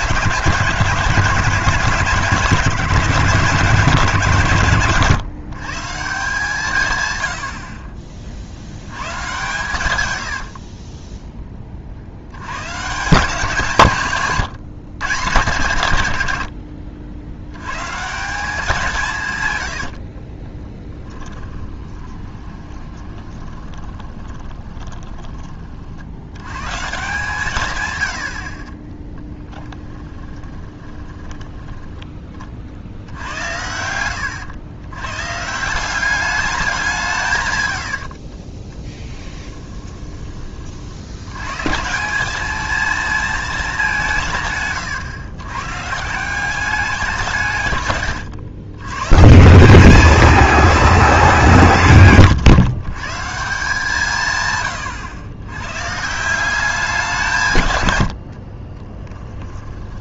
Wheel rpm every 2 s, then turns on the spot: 170, 150, 120, 140, 90, 50, 140, 140, 70, 170, 20, 20, 20, 130, 40, 20, 60, 100, 180, 20, 50, 220, 130, 190, 110, 220, 150, 120, 180, 30.
10-12 20-26 30-32 38-40 58-60